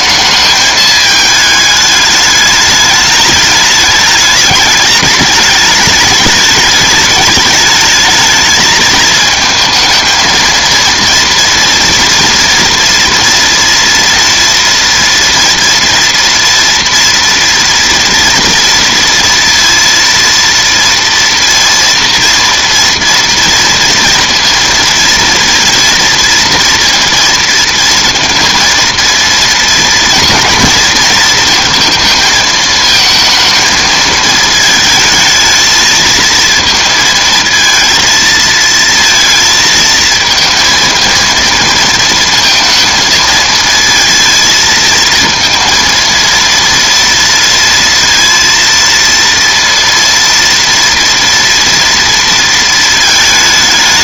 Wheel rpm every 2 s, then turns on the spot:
220, 210, 210, 210, 220, 230, 240, 240, 230, 230, 230, 230, 230, 240, 230, 230, 220, 220, 230, 230, 230, 230, 230, 230, 230, 230, 220.
none